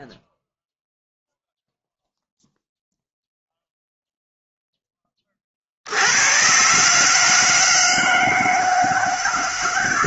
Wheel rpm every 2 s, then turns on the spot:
0, 0, 10, 140, 160.
none